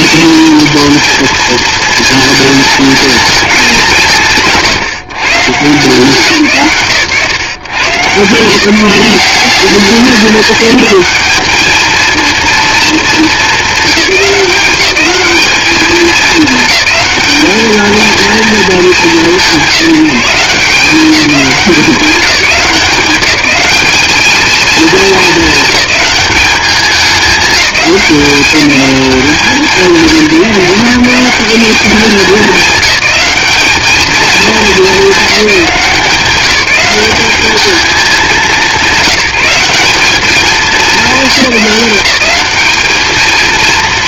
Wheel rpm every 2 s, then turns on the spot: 220, 200, 150, 120, 190, 220, 200, 210, 220, 190, 190, 190, 220, 210, 190, 190, 210, 200, 210, 180, 200, 230.
none